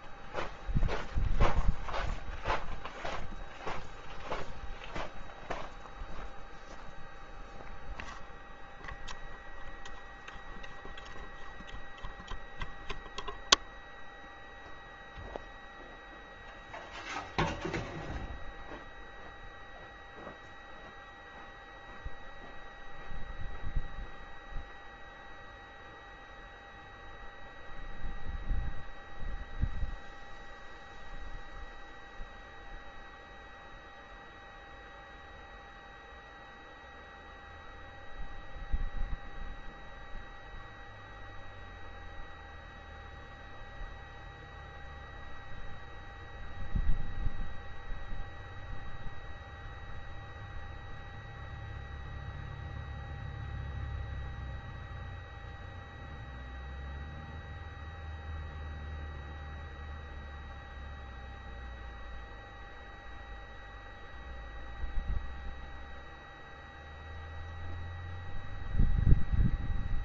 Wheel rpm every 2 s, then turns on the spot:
0, 0, 0, 0, 0, 0, 0, 0, 0, 0, 0, 0, 0, 0, 0, 0, 0, 0, 0, 0, 0, 0, 0, 0, 0, 0, 0, 0, 0, 0, 0, 0, 0, 0, 0.
none